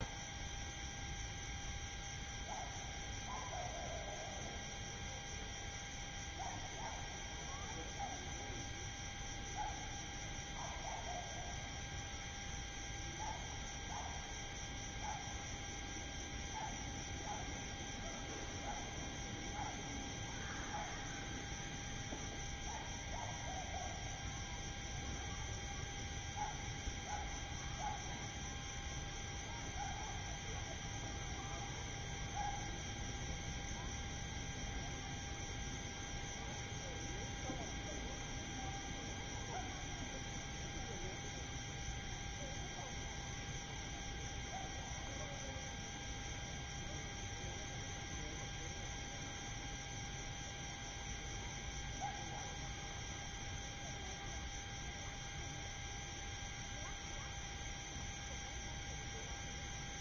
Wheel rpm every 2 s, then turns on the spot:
0, 0, 0, 0, 0, 0, 0, 0, 0, 0, 0, 0, 0, 0, 0, 0, 0, 0, 0, 0, 0, 0, 0, 0, 0, 0, 0, 0, 0, 0.
none